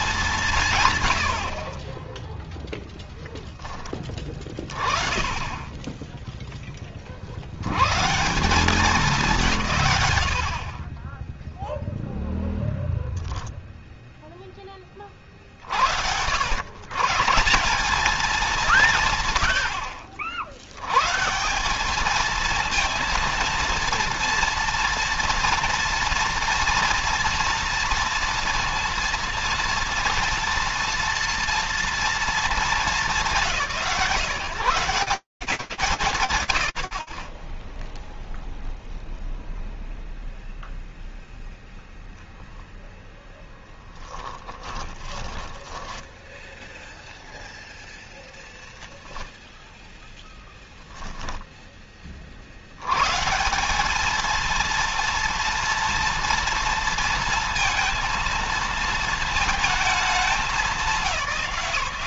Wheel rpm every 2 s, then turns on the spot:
200, 10, 20, 10, 170, 120, 0, 0, 90, 200, 60, 220, 230, 230, 230, 240, 230, 140, 20, 0, 10, 10, 20, 0, 20, 0, 70, 230, 230, 230, 210.
2-4 44-46